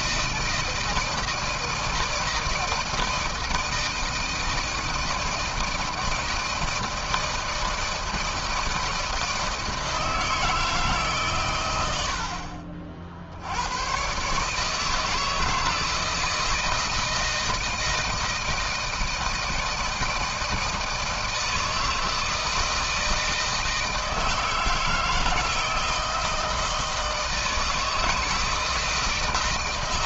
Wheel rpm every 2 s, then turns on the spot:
160, 160, 160, 160, 160, 150, 60, 160, 160, 160, 160, 160, 160, 160, 160.
none